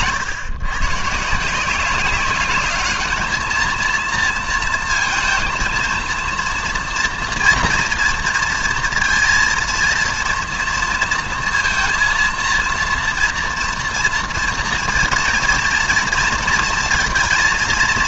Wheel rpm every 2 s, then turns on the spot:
120, 200, 230, 230, 230, 230, 230, 240, 230.
none